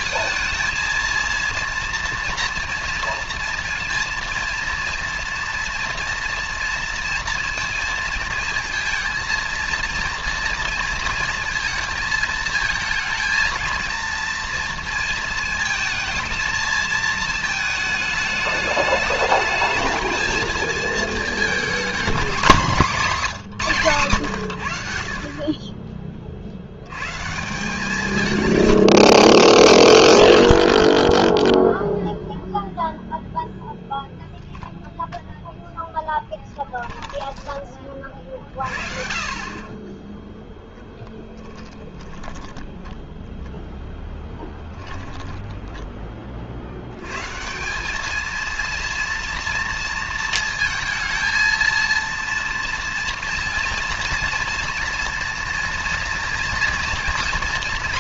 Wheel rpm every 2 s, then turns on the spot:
230, 230, 230, 230, 220, 230, 220, 230, 220, 210, 220, 210, 80, 60, 110, 50, 0, 0, 20, 40, 0, 10, 10, 100, 230, 220, 230, 230, 240.
36-38 44-46